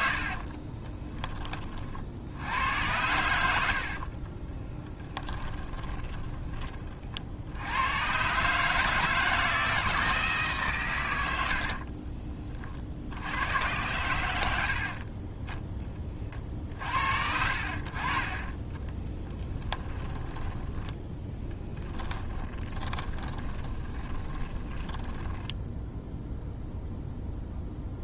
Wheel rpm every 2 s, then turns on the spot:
30, 100, 10, 40, 150, 130, 50, 70, 60, 20, 10, 20, 10, 0.
0-2 4-6 14-16 18-26